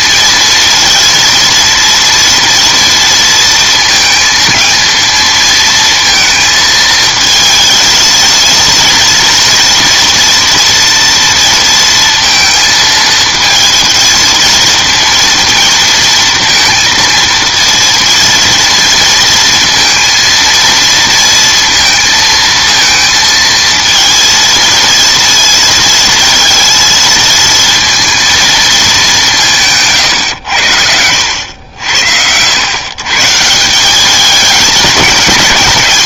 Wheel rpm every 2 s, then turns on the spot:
230, 230, 220, 220, 230, 230, 230, 230, 230, 230, 230, 230, 230, 220, 220, 90, 110, 210.
none